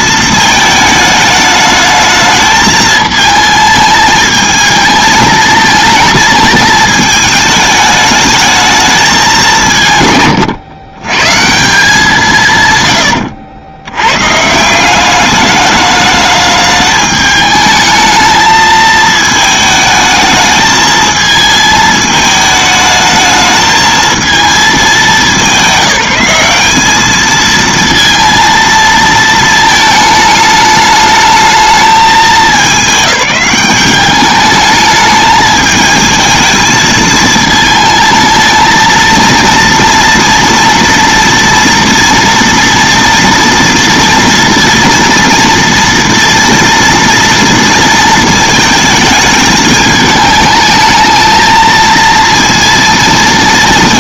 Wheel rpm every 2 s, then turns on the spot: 220, 220, 220, 220, 220, 120, 140, 170, 210, 220, 220, 220, 210, 200, 230, 210, 210, 210, 220, 230, 230, 230, 230, 230, 220, 220, 230.
12-14